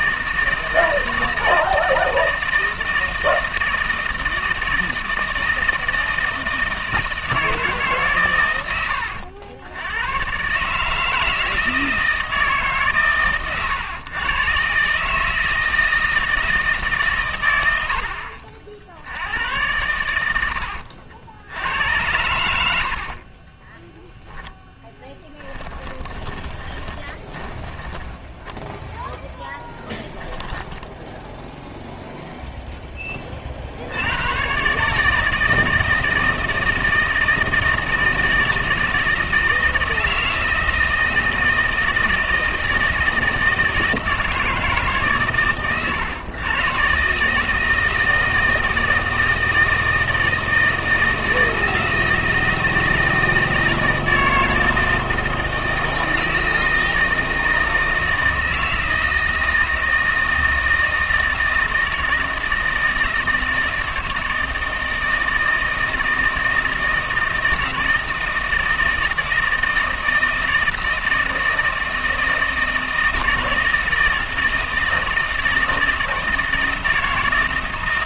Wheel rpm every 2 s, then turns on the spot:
160, 160, 160, 160, 100, 140, 150, 130, 160, 60, 80, 80, 10, 20, 10, 10, 0, 130, 160, 160, 160, 160, 150, 120, 160, 160, 160, 160, 160, 160, 160, 160, 160, 160, 160, 160, 160, 160, 160.
26-32